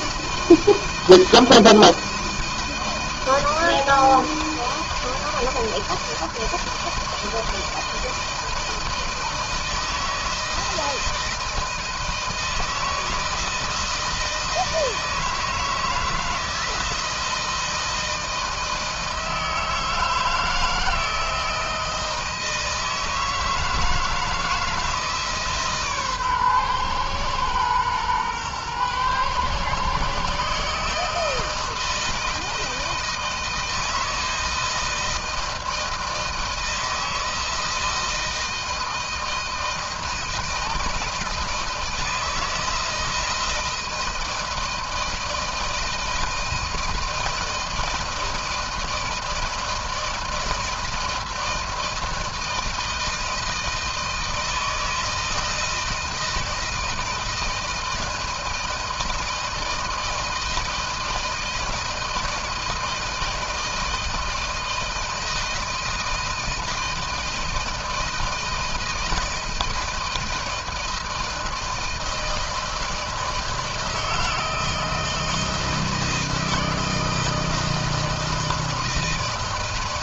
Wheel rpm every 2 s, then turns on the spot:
160, 160, 160, 160, 160, 160, 160, 160, 160, 160, 160, 160, 160, 130, 120, 140, 160, 160, 160, 160, 160, 160, 160, 160, 160, 160, 160, 160, 160, 160, 160, 160, 160, 160, 160, 160, 160, 160, 160, 160.
none